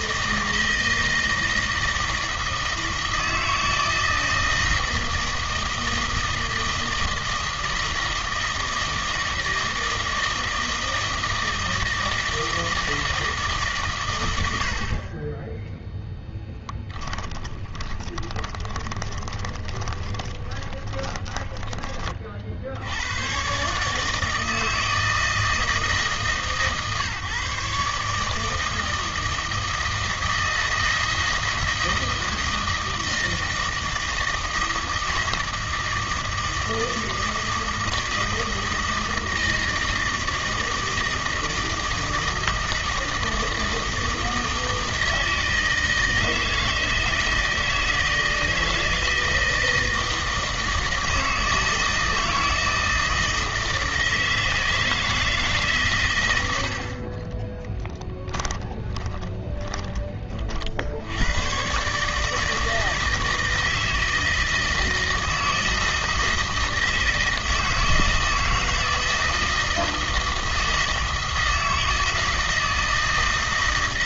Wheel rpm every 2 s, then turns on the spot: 160, 160, 160, 160, 160, 160, 160, 60, 10, 20, 20, 60, 160, 150, 160, 160, 160, 160, 160, 160, 160, 160, 160, 160, 160, 160, 160, 160, 80, 10, 40, 160, 160, 160, 160, 160, 160.
16-22 58-60